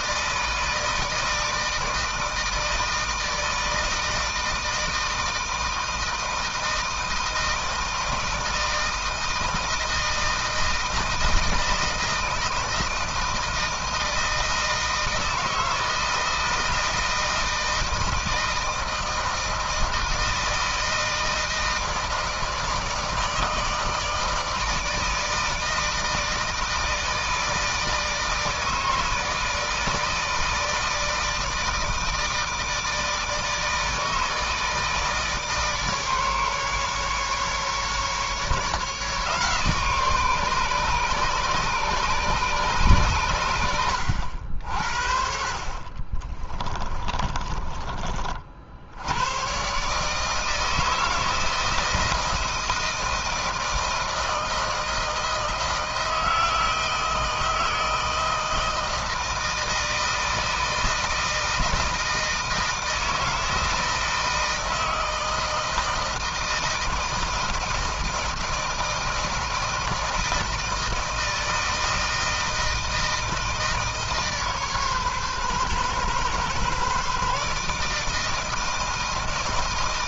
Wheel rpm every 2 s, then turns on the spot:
160, 160, 160, 160, 160, 160, 160, 160, 160, 160, 160, 160, 160, 160, 160, 160, 160, 160, 150, 150, 150, 130, 70, 30, 80, 160, 160, 160, 160, 160, 160, 160, 160, 160, 160, 160, 160, 140, 140, 160.
46-48